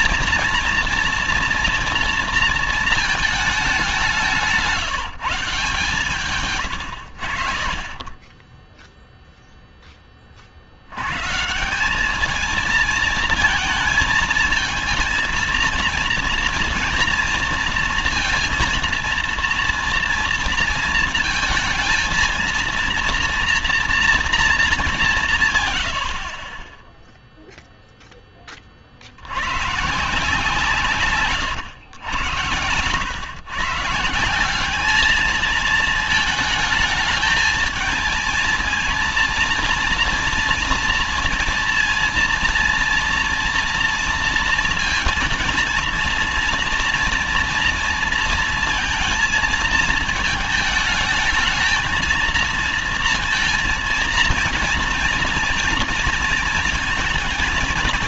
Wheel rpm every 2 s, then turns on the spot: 230, 230, 170, 110, 10, 50, 210, 220, 230, 230, 230, 230, 220, 30, 20, 170, 120, 190, 220, 230, 230, 230, 230, 230, 230, 220, 230, 230, 230.
none